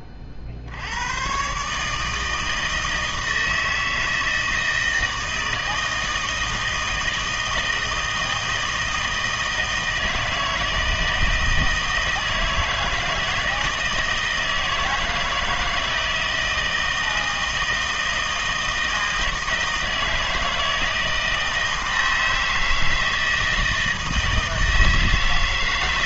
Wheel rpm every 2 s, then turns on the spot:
70, 160, 160, 160, 160, 160, 160, 160, 160, 160, 160, 160, 160.
none